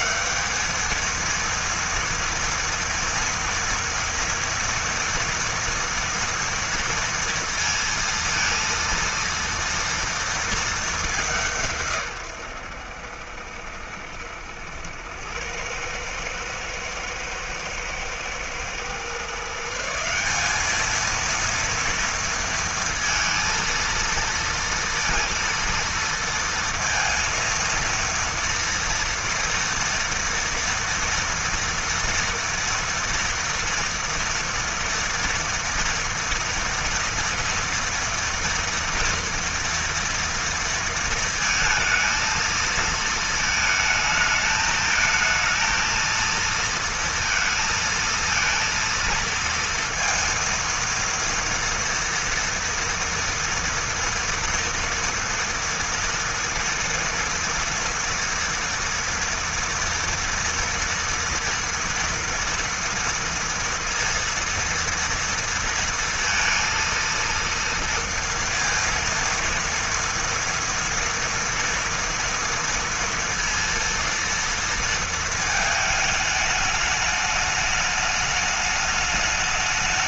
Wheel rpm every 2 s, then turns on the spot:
220, 230, 230, 230, 230, 200, 80, 90, 110, 130, 220, 230, 230, 230, 230, 230, 230, 240, 230, 230, 230, 220, 220, 230, 230, 230, 230, 230, 230, 230, 230, 230, 230, 230, 230, 230, 230, 230, 210, 210.
none